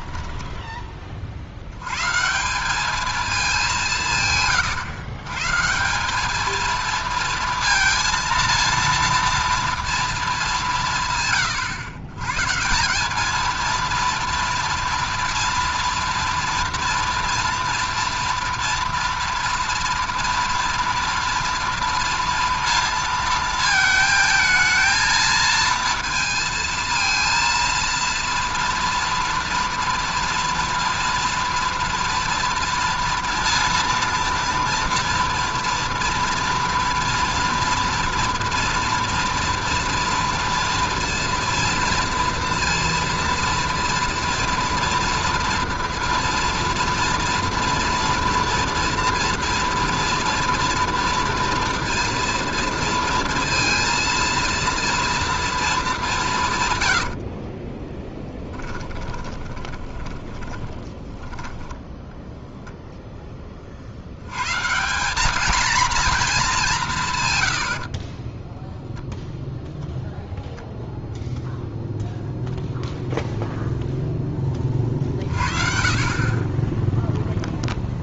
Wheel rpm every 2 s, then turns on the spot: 20, 200, 120, 230, 230, 170, 170, 230, 230, 230, 230, 230, 220, 230, 230, 230, 230, 230, 230, 230, 230, 230, 230, 230, 230, 230, 230, 230, 150, 20, 20, 0, 120, 190, 10, 0, 0, 20, 20.
58-62 68-70 76-78